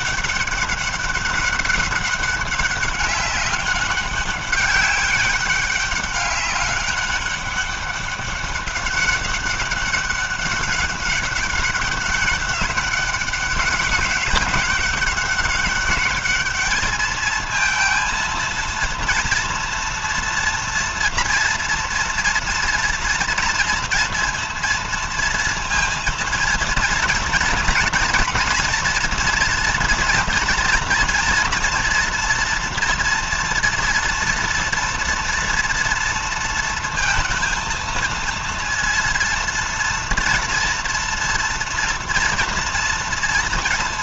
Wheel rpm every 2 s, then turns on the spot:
200, 200, 200, 200, 190, 200, 200, 190, 220, 230, 240, 230, 230, 230, 240, 230, 240, 230, 230, 230, 230, 230.
none